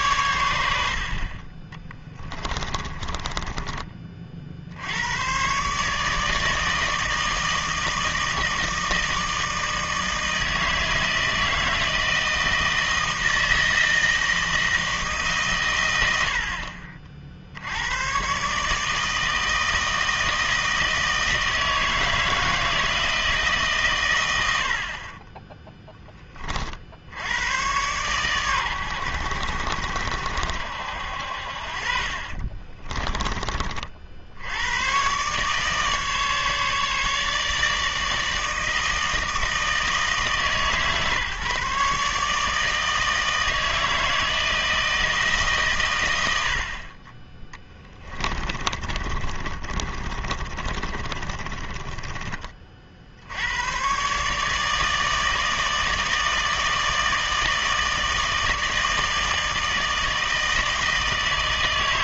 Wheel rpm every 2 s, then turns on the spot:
90, 20, 60, 160, 160, 160, 160, 170, 60, 140, 160, 160, 70, 40, 110, 70, 30, 90, 150, 160, 150, 150, 160, 70, 30, 30, 30, 150, 160, 160, 160.
2-4 32-34 48-52